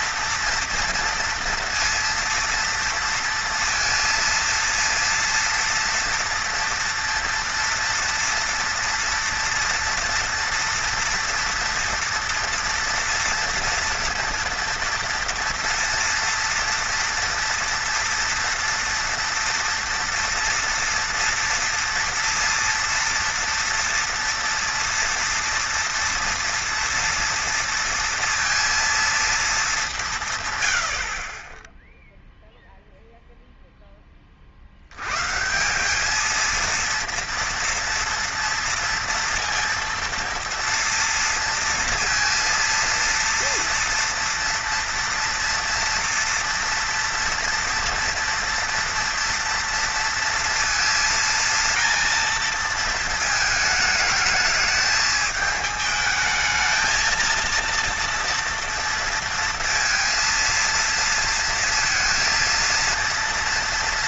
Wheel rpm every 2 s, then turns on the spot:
230, 230, 230, 230, 230, 230, 230, 230, 240, 230, 230, 230, 230, 230, 230, 130, 0, 40, 220, 230, 230, 230, 230, 240, 230, 230, 230, 210, 220, 230, 230, 230.
none